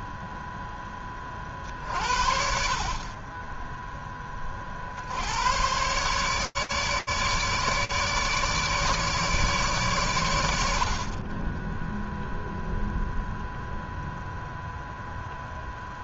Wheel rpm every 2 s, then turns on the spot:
30, 20, 110, 150, 140, 20, 0, 10.
none